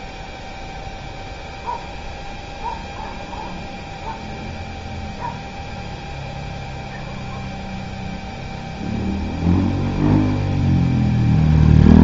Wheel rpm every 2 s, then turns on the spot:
0, 0, 0, 0, 0, 0.
none